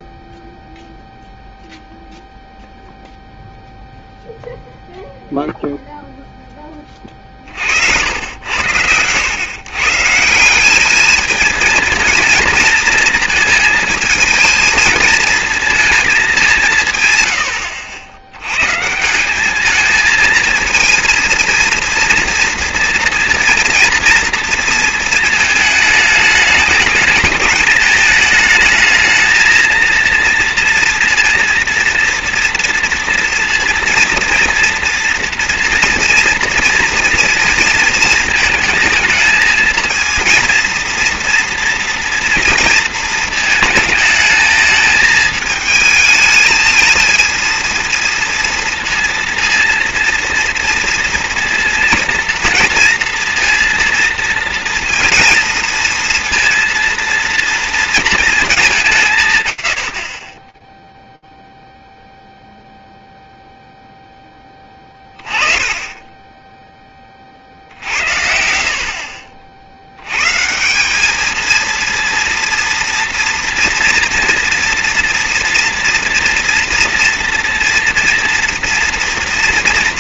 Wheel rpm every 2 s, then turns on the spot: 0, 0, 0, 10, 90, 190, 230, 220, 180, 120, 230, 230, 230, 210, 220, 230, 240, 230, 230, 220, 230, 230, 220, 220, 230, 230, 230, 230, 230, 210, 10, 0, 20, 20, 60, 190, 230, 230, 230, 230.
60-62